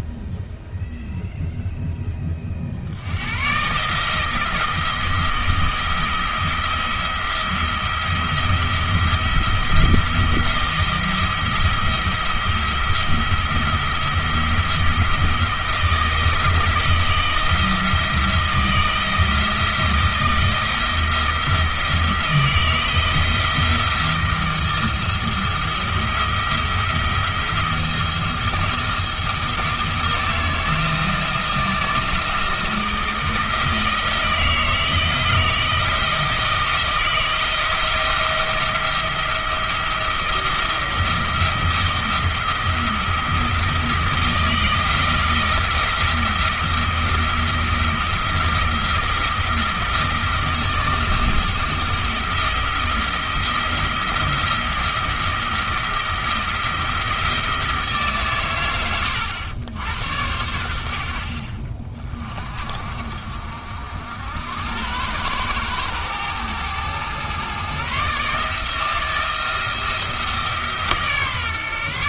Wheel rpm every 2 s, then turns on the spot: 0, 60, 160, 170, 170, 170, 170, 170, 160, 170, 170, 160, 170, 170, 170, 160, 160, 160, 160, 170, 170, 170, 160, 170, 170, 160, 170, 170, 170, 100, 70, 40, 90, 110, 160, 150.
none